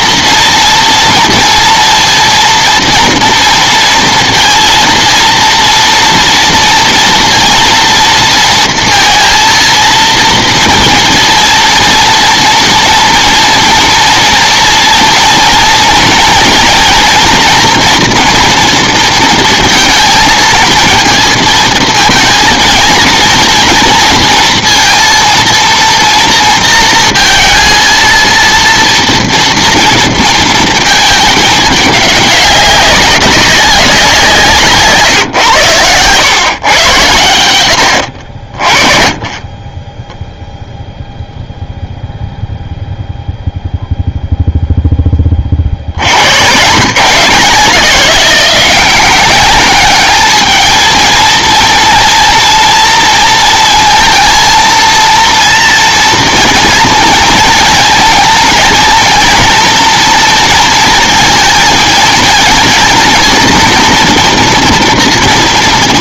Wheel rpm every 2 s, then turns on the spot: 230, 230, 230, 230, 230, 230, 230, 230, 230, 240, 230, 220, 230, 230, 230, 230, 200, 170, 130, 40, 0, 0, 0, 120, 190, 220, 240, 230, 230, 230, 230, 230, 230.
none